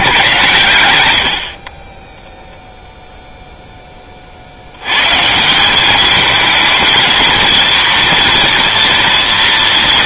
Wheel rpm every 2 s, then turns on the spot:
100, 0, 100, 220, 230.
none